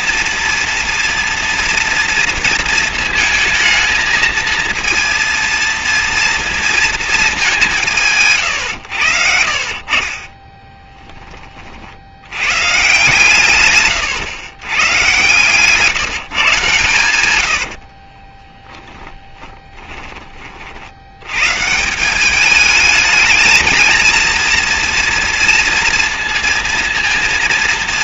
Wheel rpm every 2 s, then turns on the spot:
230, 230, 230, 230, 110, 20, 120, 110, 120, 10, 50, 210, 230, 230.
10-12 18-20